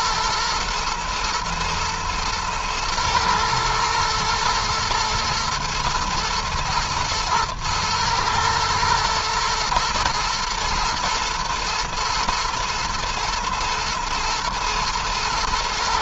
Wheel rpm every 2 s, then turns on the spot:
120, 120, 110, 110, 110, 120, 120, 110.
none